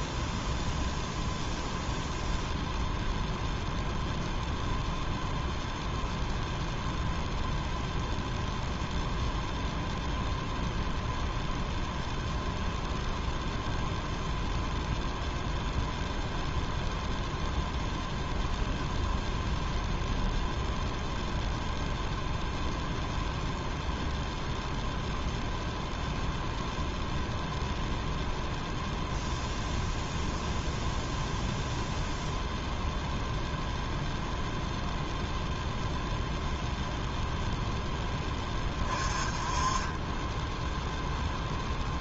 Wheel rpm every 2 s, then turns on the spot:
0, 0, 0, 0, 0, 0, 0, 0, 0, 0, 0, 0, 0, 0, 0, 0, 0, 0, 0, 20, 0.
none